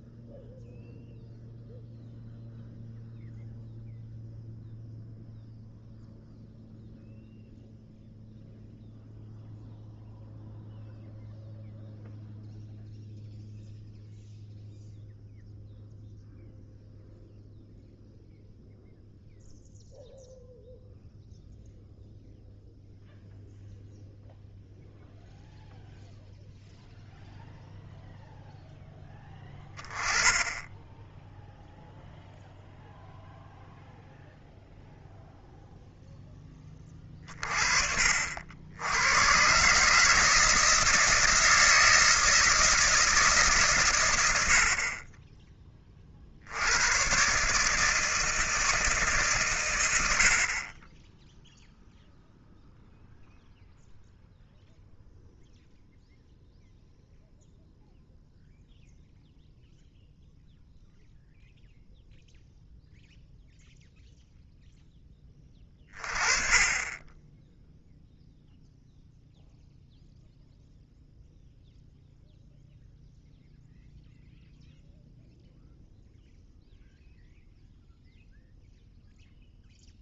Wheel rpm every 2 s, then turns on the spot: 0, 0, 0, 0, 0, 0, 0, 0, 0, 0, 0, 0, 0, 0, 0, 10, 0, 0, 20, 80, 160, 160, 70, 90, 160, 30, 0, 0, 0, 0, 0, 0, 0, 20, 0, 0, 0, 0, 0, 0.
none